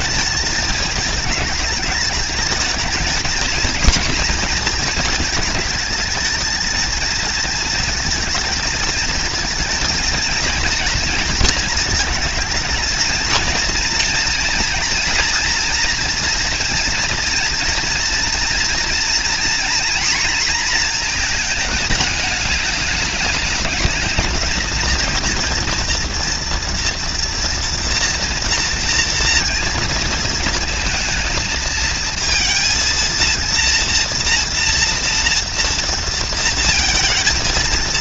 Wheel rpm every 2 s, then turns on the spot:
220, 220, 220, 230, 220, 230, 230, 230, 230, 240, 230, 200, 230, 240, 230, 220, 230, 230, 230.
none